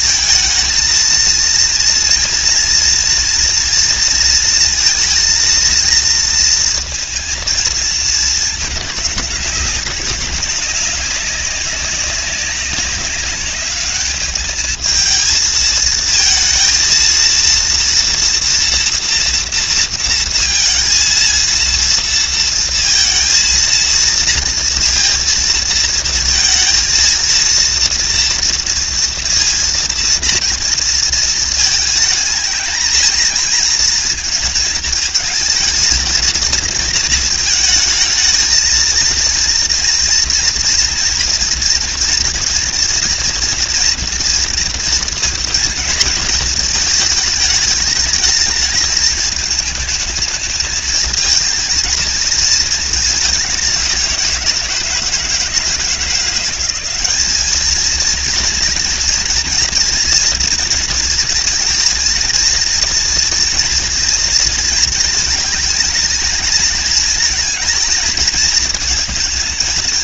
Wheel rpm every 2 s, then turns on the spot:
220, 230, 230, 230, 210, 200, 200, 220, 230, 240, 230, 230, 230, 230, 230, 230, 220, 220, 220, 230, 230, 230, 230, 220, 220, 220, 220, 170, 200, 240, 230, 230, 220, 220, 230.
none